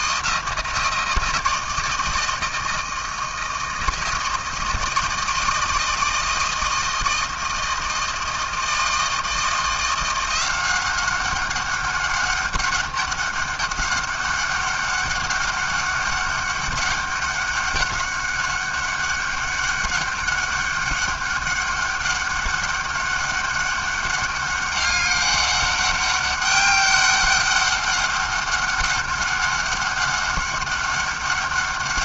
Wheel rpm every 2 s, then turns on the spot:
160, 160, 160, 160, 170, 200, 200, 200, 200, 200, 200, 200, 200, 200, 200, 200.
none